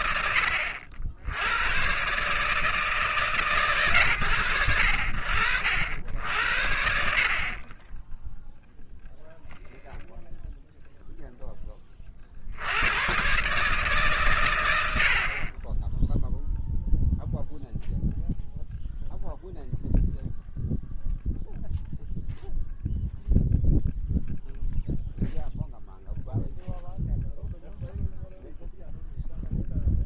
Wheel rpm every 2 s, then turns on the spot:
90, 130, 60, 60, 10, 10, 140, 30, 0, 0, 0, 0, 0, 0, 0.
none